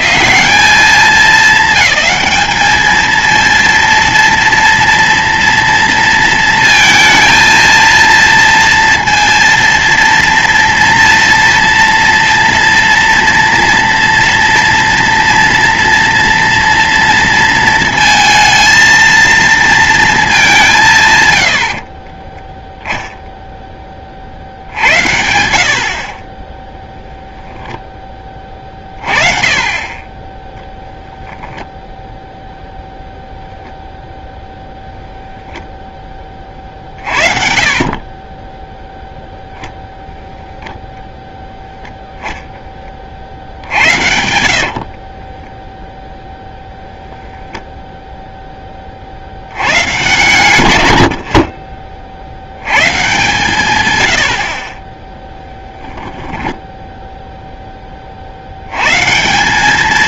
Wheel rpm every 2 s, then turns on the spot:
210, 230, 230, 230, 230, 230, 230, 230, 230, 200, 10, 30, 40, 10, 20, 0, 0, 10, 30, 0, 0, 30, 40, 0, 40, 60, 120, 20, 10, 100.
20-22 28-30 44-46 56-58